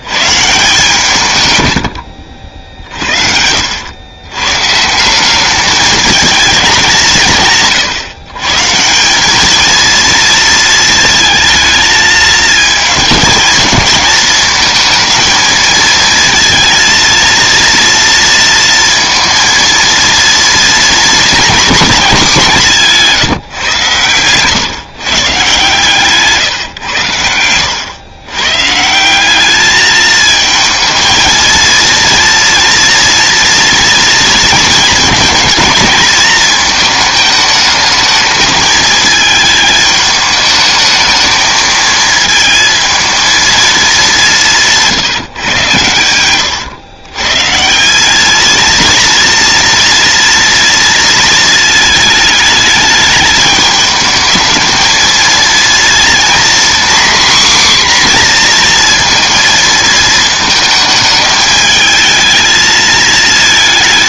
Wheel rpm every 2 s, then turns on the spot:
140, 60, 130, 210, 150, 220, 220, 220, 230, 230, 230, 190, 130, 140, 130, 220, 230, 220, 220, 220, 220, 220, 180, 110, 220, 230, 220, 220, 250, 240, 220, 220.
44-46